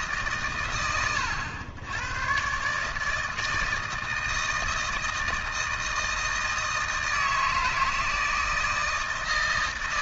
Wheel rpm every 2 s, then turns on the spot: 110, 160, 160, 160, 160.
none